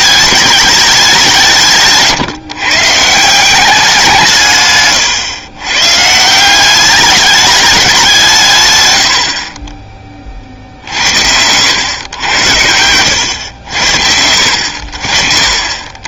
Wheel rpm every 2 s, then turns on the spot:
210, 130, 140, 190, 130, 50, 100, 70.
none